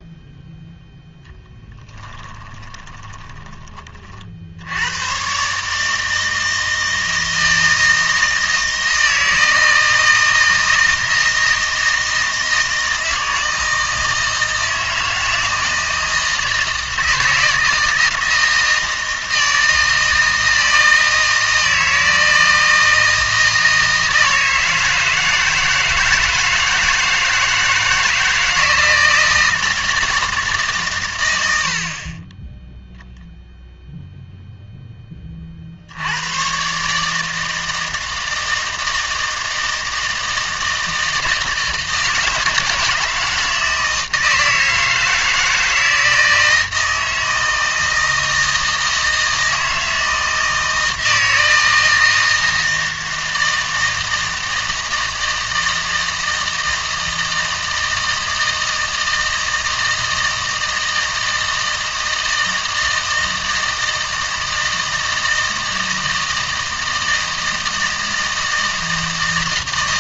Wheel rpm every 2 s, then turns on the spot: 0, 20, 70, 160, 160, 160, 160, 160, 160, 160, 160, 160, 160, 160, 160, 140, 10, 0, 130, 160, 160, 160, 160, 160, 160, 160, 160, 160, 160, 160, 160, 160, 160, 160, 160.
2-4